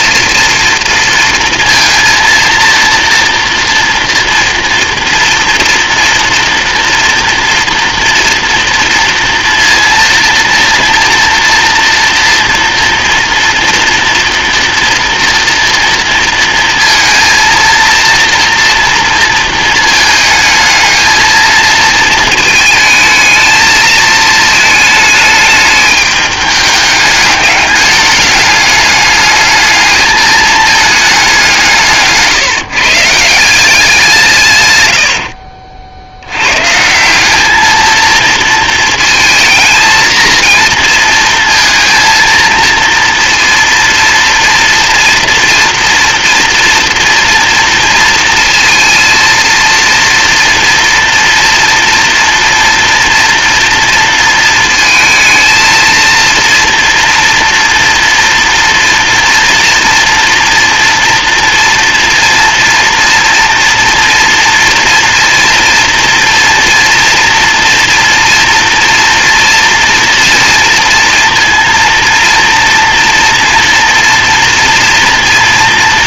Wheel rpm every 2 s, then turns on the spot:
230, 230, 230, 230, 230, 230, 230, 230, 230, 230, 220, 220, 220, 210, 210, 220, 150, 120, 130, 230, 230, 230, 230, 230, 230, 230, 230, 230, 230, 230, 230, 230, 240, 230, 230, 230, 230, 230.
none